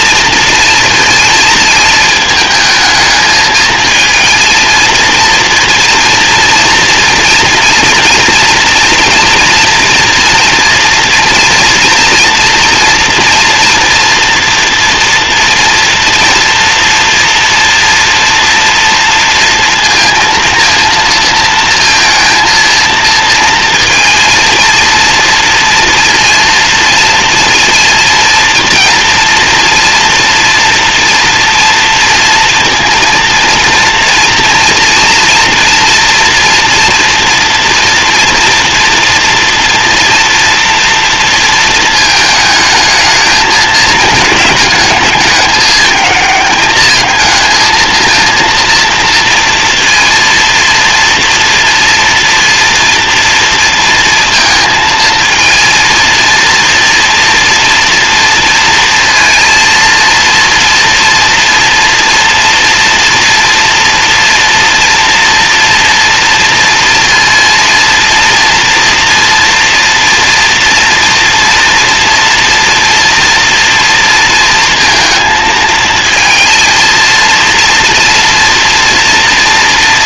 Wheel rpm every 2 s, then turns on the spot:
230, 220, 230, 230, 230, 240, 240, 230, 230, 230, 230, 230, 230, 230, 230, 230, 230, 240, 230, 230, 230, 210, 210, 220, 230, 230, 230, 230, 230, 230, 230, 230, 240, 230, 240, 230, 230, 230, 230, 230.
none